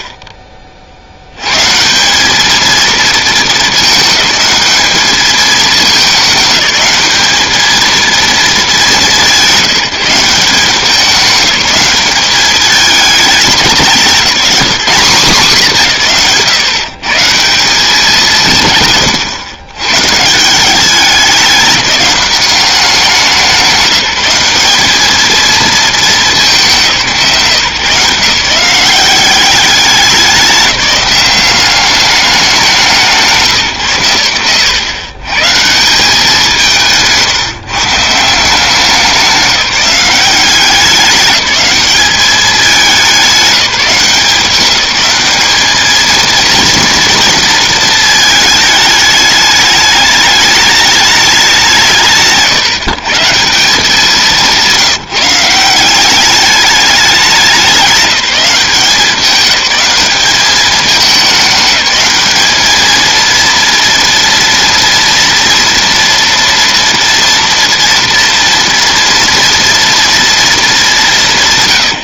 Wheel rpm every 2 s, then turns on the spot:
40, 220, 210, 210, 210, 190, 210, 210, 160, 140, 190, 190, 210, 170, 180, 190, 180, 130, 160, 180, 200, 200, 190, 230, 210, 210, 150, 170, 200, 180, 210, 220, 230, 230, 230, 190.
none